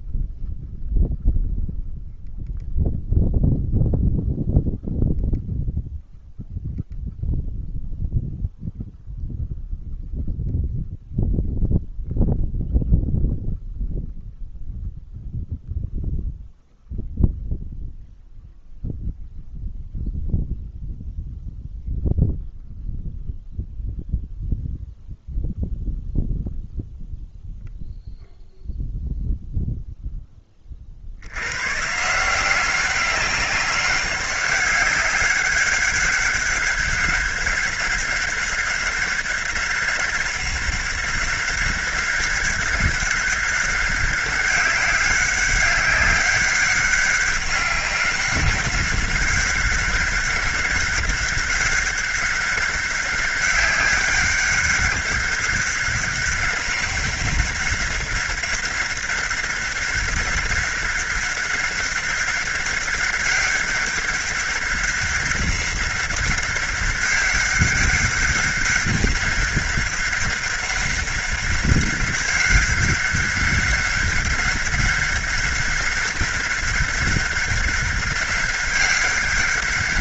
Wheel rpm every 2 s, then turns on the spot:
0, 0, 0, 0, 0, 0, 0, 0, 0, 0, 0, 0, 0, 0, 0, 60, 190, 200, 200, 200, 200, 190, 190, 200, 200, 200, 200, 200, 200, 200, 200, 200, 190, 200, 200, 200, 200, 200, 200, 190.
none